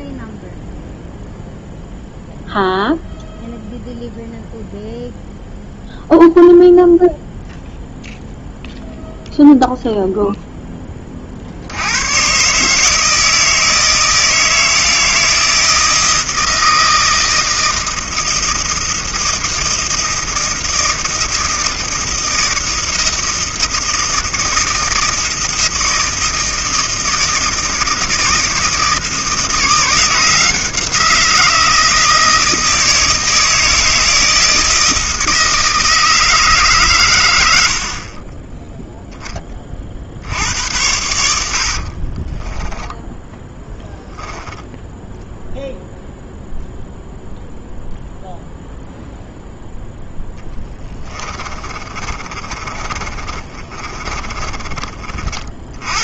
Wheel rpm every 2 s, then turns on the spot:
0, 0, 0, 0, 0, 10, 140, 160, 160, 160, 160, 160, 160, 160, 160, 170, 160, 160, 140, 10, 90, 10, 10, 0, 0, 20, 30, 30.
38-40 42-46 50-56